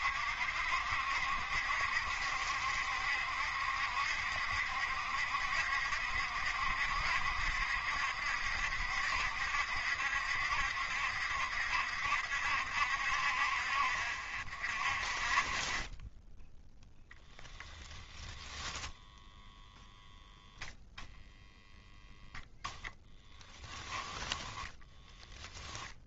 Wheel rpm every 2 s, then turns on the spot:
70, 70, 70, 70, 70, 70, 60, 10, 0, 10, 0, 0, 10.
24-26